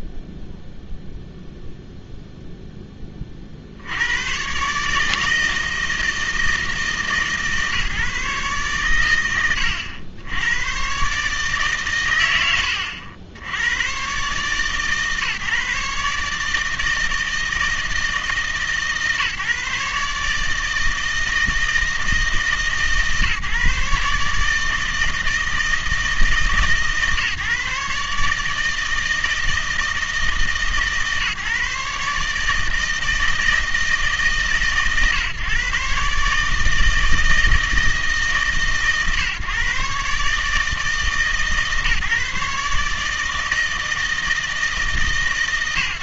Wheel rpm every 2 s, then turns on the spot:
0, 10, 140, 160, 130, 110, 90, 140, 160, 150, 160, 150, 160, 140, 160, 150, 150, 140, 160, 150, 150, 150, 160.
none